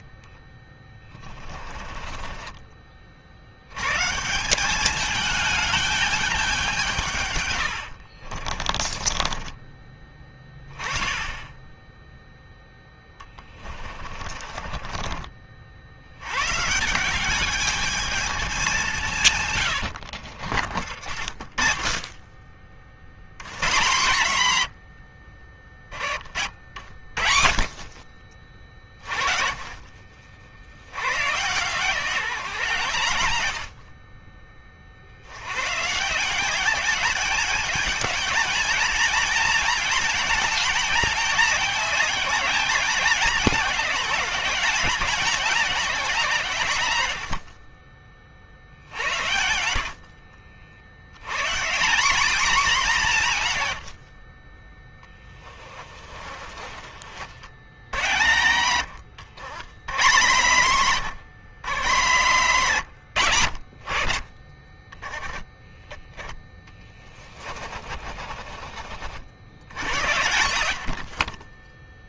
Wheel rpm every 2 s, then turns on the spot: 20, 40, 200, 170, 30, 20, 10, 40, 170, 190, 50, 60, 90, 60, 40, 100, 140, 50, 200, 220, 220, 200, 200, 110, 50, 90, 200, 20, 50, 90, 130, 90, 10, 20, 60, 70.
0-2 8-10 12-16 48-50 54-56 66-68